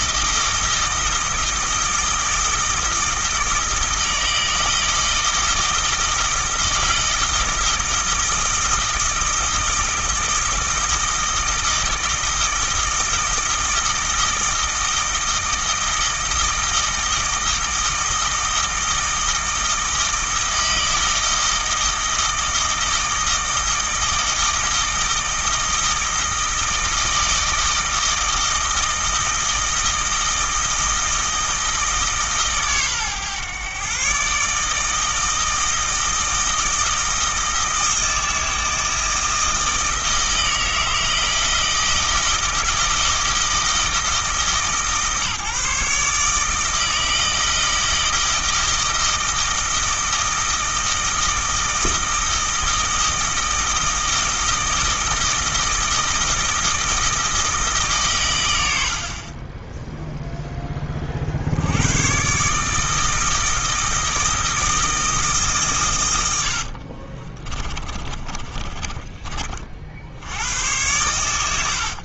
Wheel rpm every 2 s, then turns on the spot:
160, 160, 160, 160, 160, 160, 160, 160, 160, 160, 160, 160, 160, 160, 160, 160, 130, 150, 160, 160, 160, 160, 150, 160, 160, 160, 160, 160, 160, 80, 20, 150, 160, 50, 20, 100.
66-70